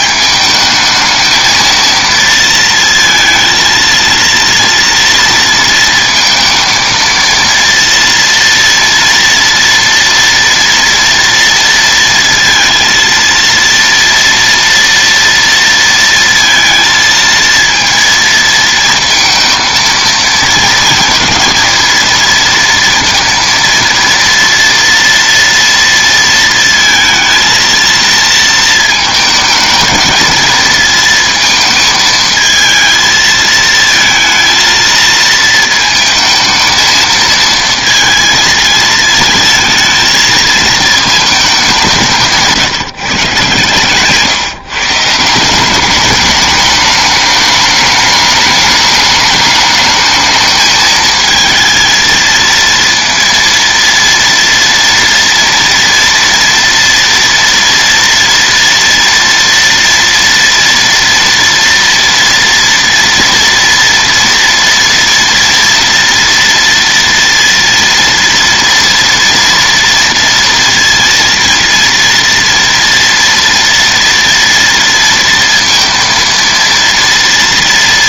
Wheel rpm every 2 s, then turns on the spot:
220, 230, 230, 230, 230, 230, 230, 230, 230, 230, 220, 230, 230, 230, 220, 230, 220, 230, 220, 220, 220, 170, 140, 210, 210, 220, 230, 230, 230, 230, 230, 230, 230, 230, 230, 230, 230, 230, 230.
none